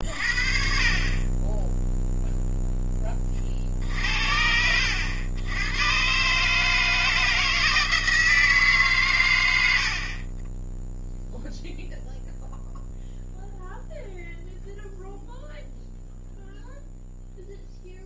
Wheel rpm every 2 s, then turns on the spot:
40, 0, 80, 160, 150, 20, 0, 0, 0.
none